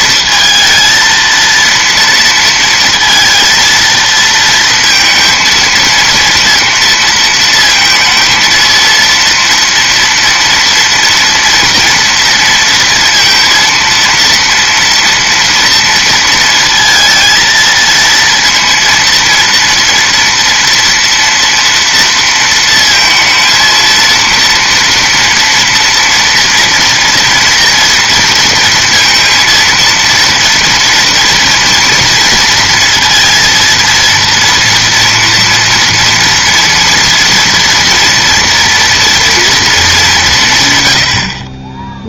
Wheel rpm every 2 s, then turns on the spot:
230, 230, 230, 230, 230, 230, 230, 230, 230, 230, 230, 230, 230, 230, 230, 230, 230, 230, 230, 240, 150.
none